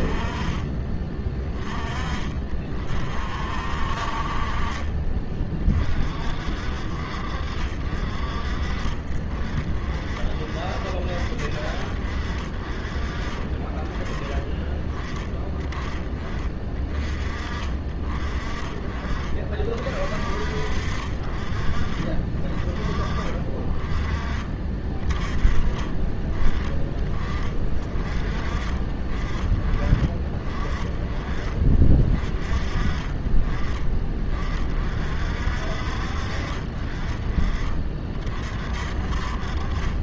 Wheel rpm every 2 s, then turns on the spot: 30, 50, 40, 50, 50, 50, 20, 20, 30, 40, 40, 30, 20, 30, 30, 30, 30, 50, 30, 50.
none